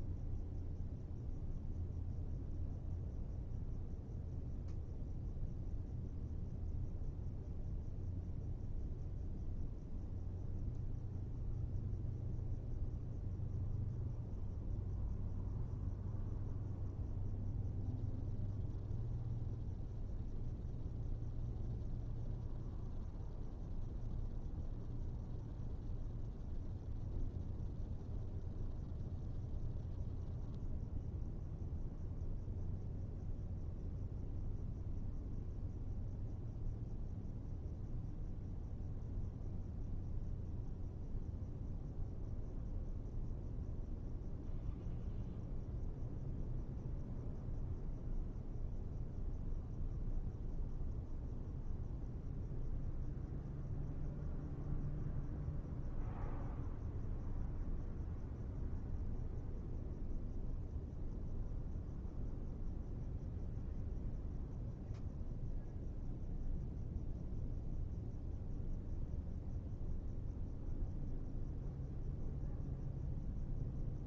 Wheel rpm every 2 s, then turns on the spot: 0, 0, 0, 0, 0, 0, 0, 0, 0, 0, 0, 0, 0, 0, 0, 0, 0, 0, 0, 0, 0, 0, 0, 0, 0, 0, 0, 0, 0, 0, 0, 0, 0, 0, 0, 0, 0.
none